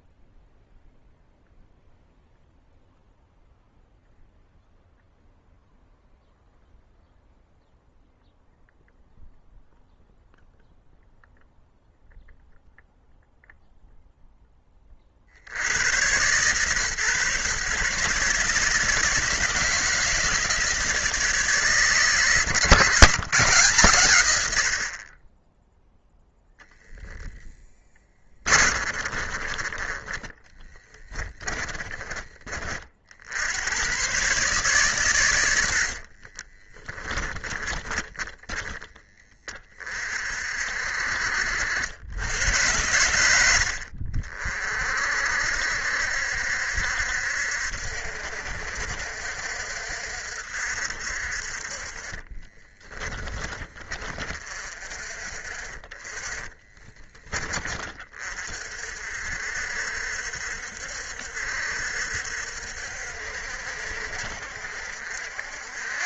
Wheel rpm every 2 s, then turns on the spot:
0, 0, 0, 0, 0, 0, 0, 120, 140, 160, 150, 110, 0, 20, 20, 30, 110, 80, 20, 40, 80, 70, 60, 60, 60, 30, 20, 10, 20, 60, 60, 60, 80.
26-28 30-32 34-38 52-54